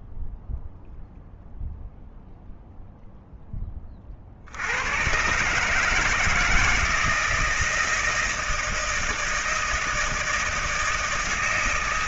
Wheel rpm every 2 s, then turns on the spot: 0, 0, 100, 160, 160, 160.
none